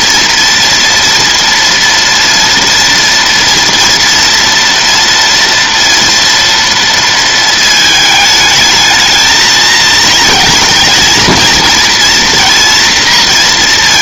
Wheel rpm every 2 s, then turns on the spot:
240, 230, 230, 230, 220, 220, 230.
none